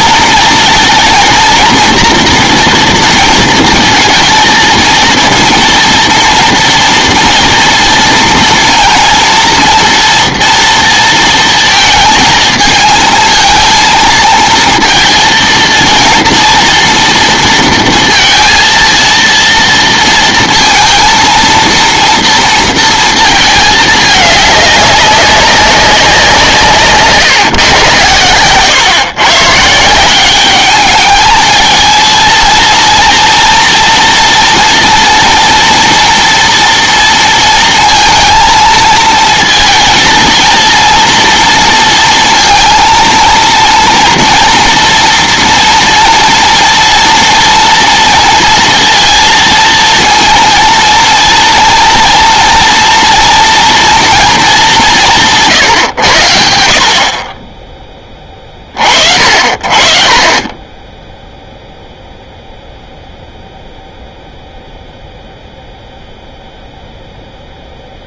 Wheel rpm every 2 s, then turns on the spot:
230, 230, 230, 230, 230, 230, 230, 220, 230, 230, 230, 230, 200, 150, 130, 210, 230, 240, 230, 220, 230, 230, 240, 230, 230, 230, 230, 200, 60, 50, 10, 0, 0, 0.
none